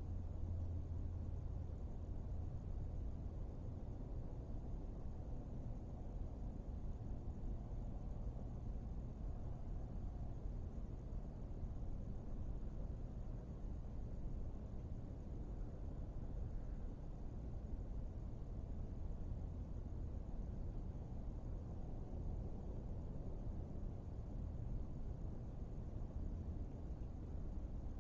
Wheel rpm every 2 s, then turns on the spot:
0, 0, 0, 0, 0, 0, 0, 0, 0, 0, 0, 0, 0, 0.
none